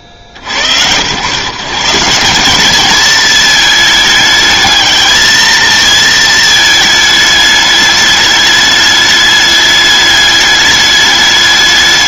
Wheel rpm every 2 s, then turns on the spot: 70, 200, 210, 220, 210, 210.
none